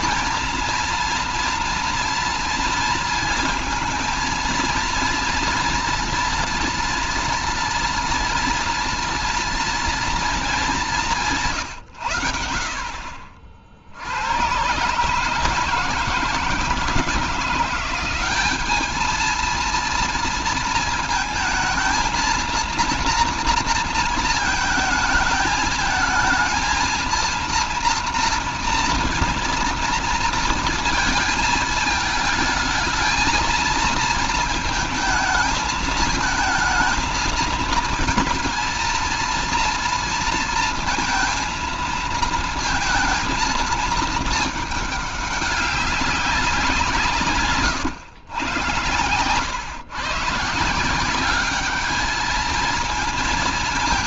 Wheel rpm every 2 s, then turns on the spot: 230, 230, 230, 230, 230, 220, 70, 130, 160, 210, 230, 230, 220, 220, 240, 230, 220, 230, 220, 230, 230, 220, 210, 170, 100, 160, 230.
none